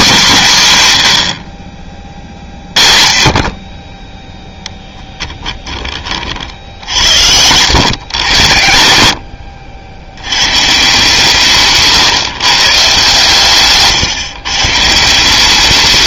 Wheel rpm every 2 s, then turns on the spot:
190, 40, 10, 60, 90, 140, 150, 150.
4-8